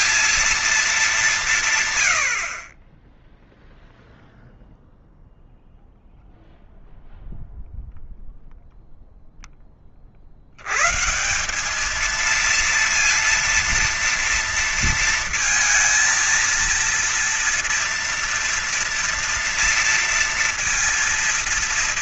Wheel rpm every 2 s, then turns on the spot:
230, 50, 0, 0, 0, 70, 220, 230, 230, 240, 230.
none